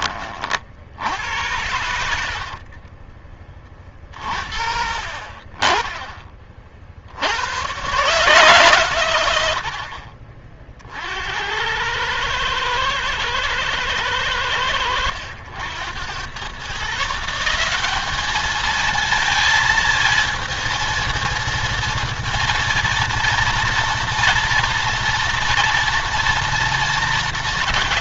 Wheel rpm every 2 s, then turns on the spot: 40, 50, 50, 40, 140, 50, 110, 90, 120, 210, 230, 230, 240, 240.
2-4